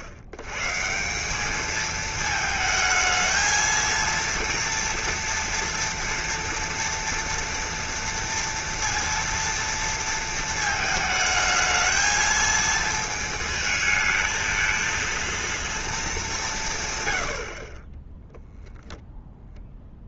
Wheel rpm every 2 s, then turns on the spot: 110, 220, 230, 230, 230, 220, 220, 220, 170, 0.
none